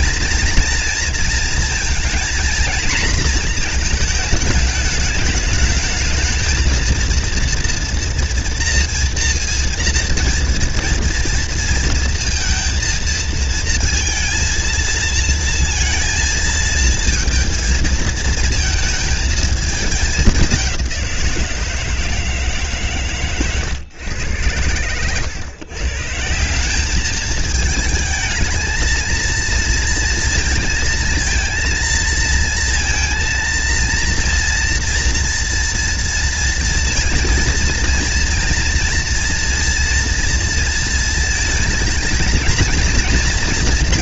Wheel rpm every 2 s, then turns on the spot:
230, 230, 210, 230, 240, 230, 230, 230, 230, 220, 180, 130, 110, 200, 220, 230, 230, 230, 230, 230, 230, 230.
none